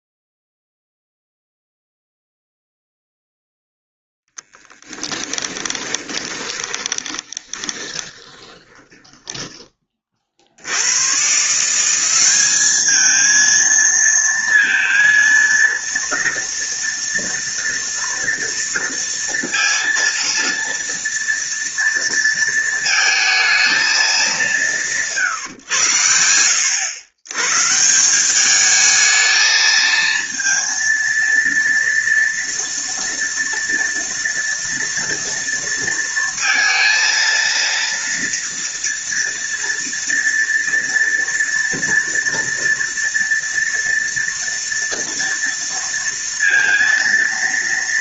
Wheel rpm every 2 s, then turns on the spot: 0, 0, 10, 20, 20, 100, 210, 230, 230, 230, 230, 230, 150, 90, 210, 230, 230, 230, 230, 230, 230, 230, 230, 230.
4-10